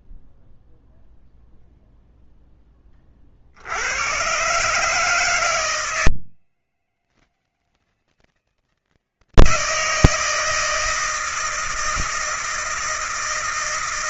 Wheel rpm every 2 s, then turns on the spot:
0, 20, 150, 160, 160, 160, 160.
none